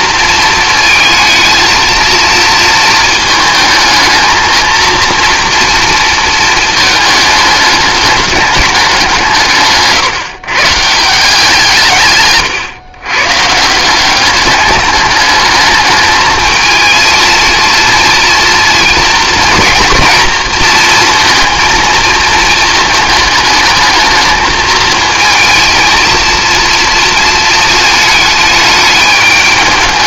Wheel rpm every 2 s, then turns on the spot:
220, 220, 230, 220, 200, 150, 130, 210, 230, 230, 230, 220, 220, 230, 210.
none